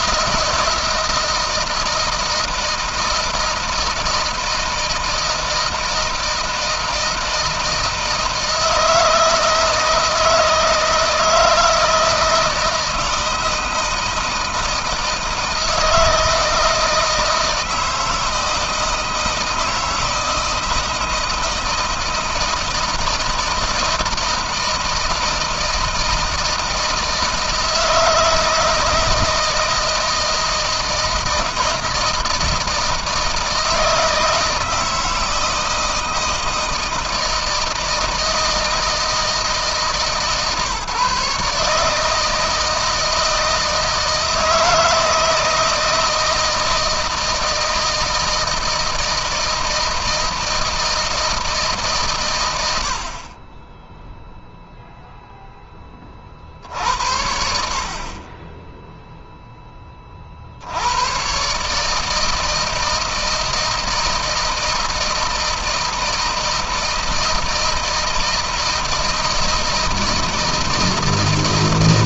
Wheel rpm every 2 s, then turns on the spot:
170, 160, 160, 160, 160, 160, 160, 160, 160, 160, 160, 160, 160, 160, 160, 160, 160, 160, 160, 160, 150, 160, 160, 160, 160, 160, 70, 0, 70, 10, 90, 160, 160, 160, 160, 160.
none